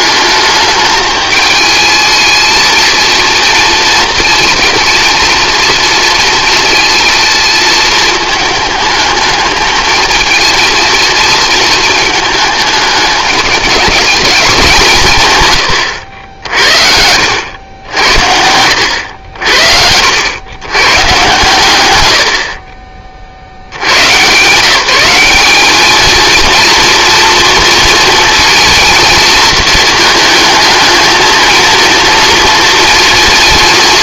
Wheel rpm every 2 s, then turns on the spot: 210, 220, 230, 230, 220, 230, 220, 190, 70, 90, 110, 30, 160, 230, 230, 220, 230.
18-20